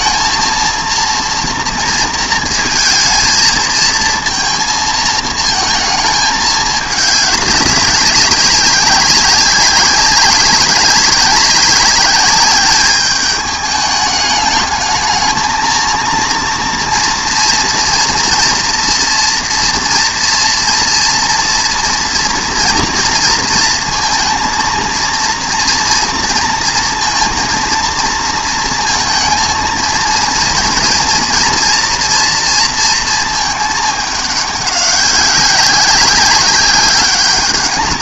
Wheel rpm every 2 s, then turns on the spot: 230, 220, 220, 210, 200, 190, 200, 210, 230, 230, 230, 230, 230, 230, 230, 230, 230, 200, 200.
none